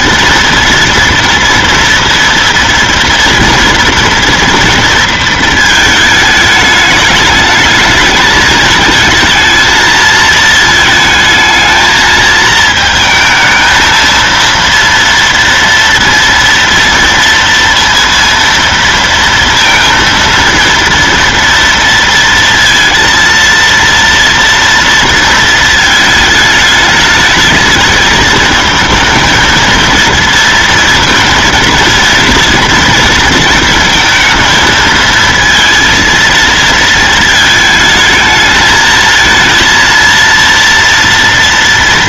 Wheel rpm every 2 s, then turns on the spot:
230, 230, 230, 210, 220, 220, 220, 230, 230, 230, 230, 230, 230, 220, 220, 230, 230, 230, 230, 220, 230.
none